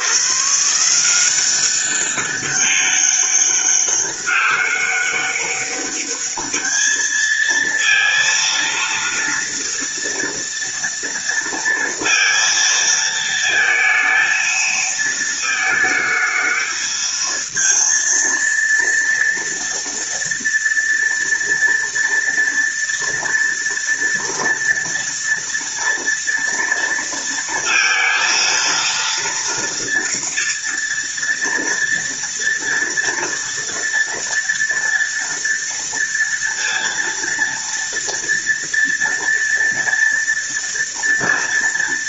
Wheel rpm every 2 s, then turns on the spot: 160, 200, 200, 220, 230, 230, 230, 220, 220, 230, 230, 230, 230, 230, 230, 230, 230, 230, 230, 230, 230.
none